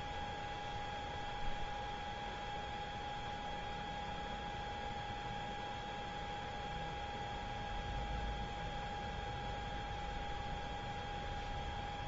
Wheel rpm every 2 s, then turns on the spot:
0, 0, 0, 0, 0, 0.
none